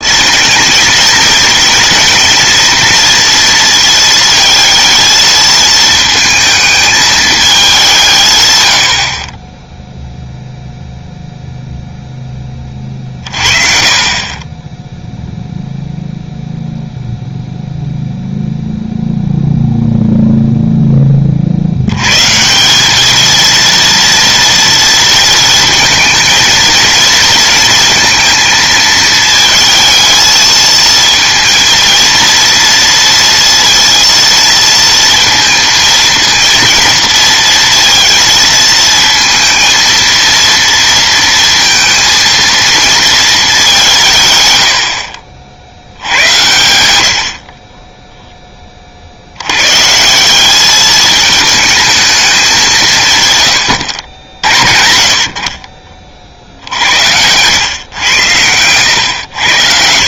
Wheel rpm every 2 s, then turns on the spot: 230, 230, 220, 220, 90, 0, 30, 10, 0, 0, 10, 190, 230, 220, 220, 220, 230, 230, 230, 230, 230, 230, 90, 90, 20, 200, 170, 60, 70, 100.
58-60